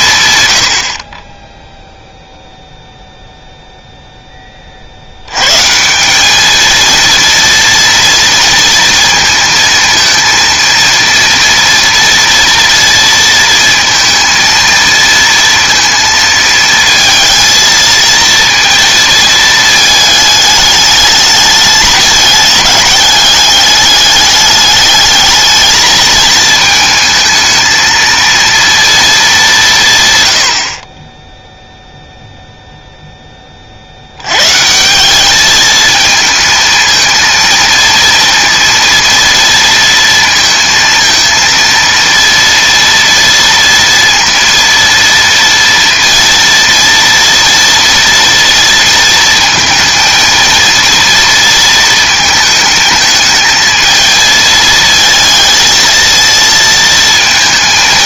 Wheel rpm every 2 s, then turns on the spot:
90, 0, 40, 220, 230, 230, 230, 230, 220, 230, 210, 200, 210, 220, 230, 60, 0, 150, 230, 230, 230, 230, 230, 230, 230, 230, 220, 220, 220.
none